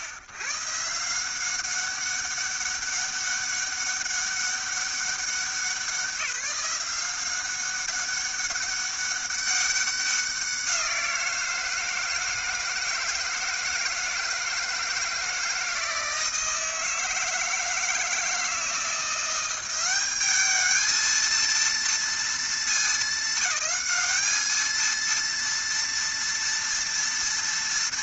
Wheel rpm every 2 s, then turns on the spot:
120, 200, 200, 180, 200, 180, 160, 160, 160, 170, 220, 220, 220, 230.
none